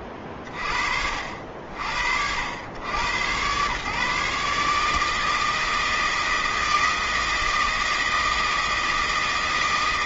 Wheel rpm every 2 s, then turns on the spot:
30, 80, 150, 160, 160.
none